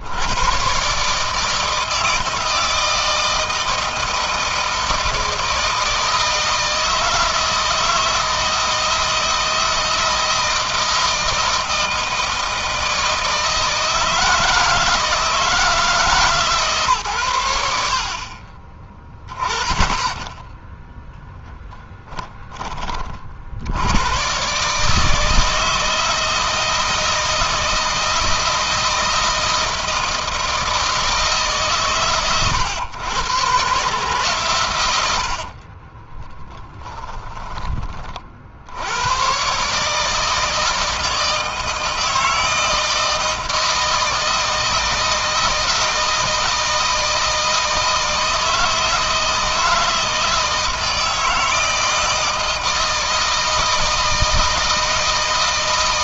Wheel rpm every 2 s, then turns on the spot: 130, 160, 160, 160, 160, 160, 160, 170, 130, 10, 0, 20, 150, 160, 160, 160, 110, 100, 10, 90, 160, 160, 160, 160, 160, 160, 160, 160.
34-38